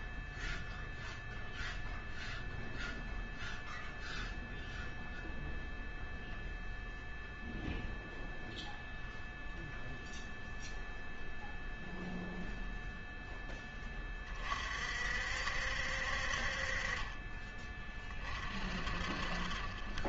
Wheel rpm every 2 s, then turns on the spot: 0, 0, 0, 0, 0, 0, 0, 50, 40, 50.
none